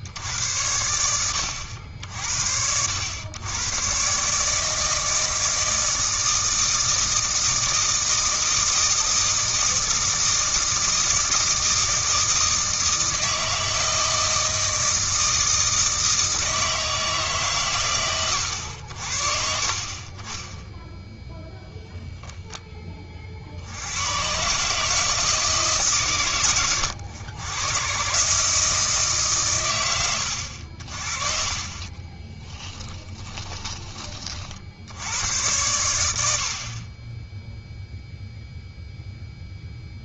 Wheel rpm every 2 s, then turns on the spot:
90, 80, 160, 160, 160, 160, 160, 160, 160, 70, 0, 20, 150, 110, 160, 60, 10, 70, 40, 0.
32-34